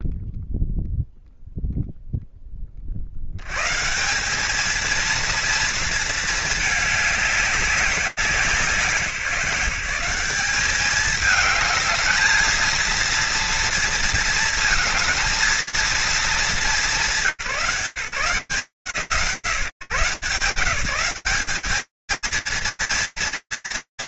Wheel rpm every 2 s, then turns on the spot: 0, 30, 210, 220, 180, 210, 230, 220, 180, 140, 160, 220.
none